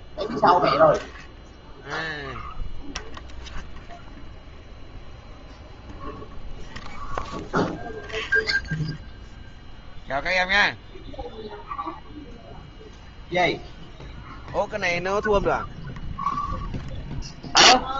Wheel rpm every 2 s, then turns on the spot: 0, 0, 0, 0, 0, 0, 0, 0, 0.
none